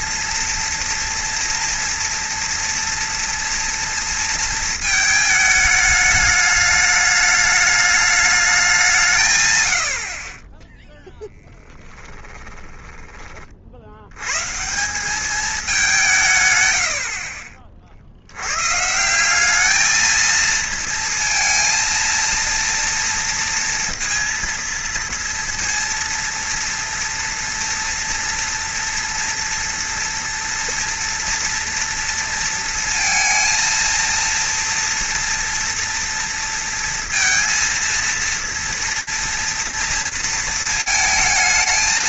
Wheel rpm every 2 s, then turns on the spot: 230, 230, 230, 210, 200, 10, 10, 170, 100, 130, 220, 230, 230, 230, 230, 230, 230, 230, 230, 230, 220.
10-14